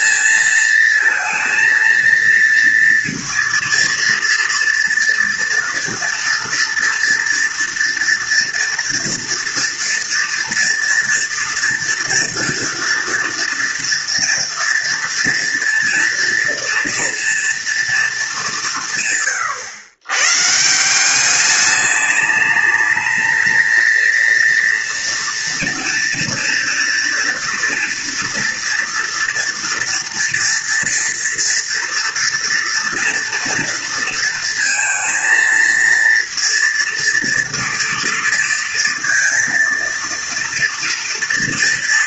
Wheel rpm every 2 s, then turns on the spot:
230, 230, 230, 230, 230, 230, 240, 230, 230, 160, 180, 220, 230, 230, 230, 230, 240, 230, 230, 230, 240.
none